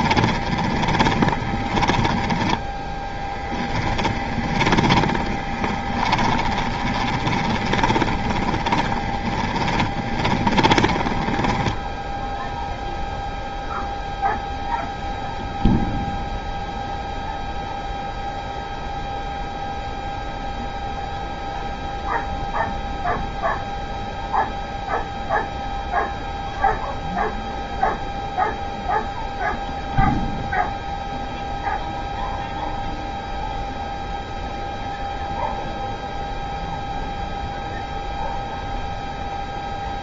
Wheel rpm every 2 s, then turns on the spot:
20, 10, 20, 20, 20, 20, 0, 0, 0, 0, 0, 0, 0, 0, 0, 0, 0, 0, 0, 0.
0-12